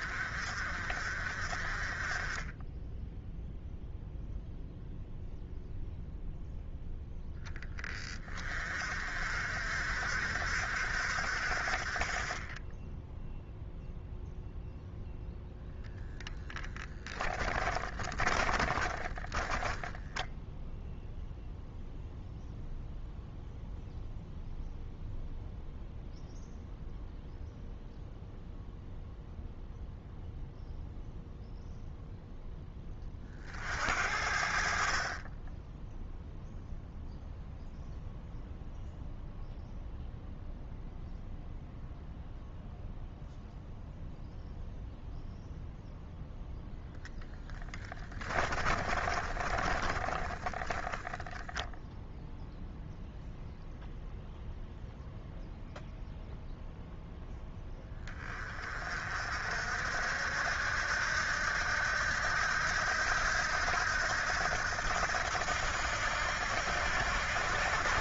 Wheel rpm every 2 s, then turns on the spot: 50, 10, 0, 0, 40, 60, 10, 0, 10, 30, 0, 0, 0, 0, 0, 0, 20, 50, 0, 0, 0, 0, 0, 0, 30, 20, 0, 0, 0, 40, 70, 80, 80, 80.
16-20 48-52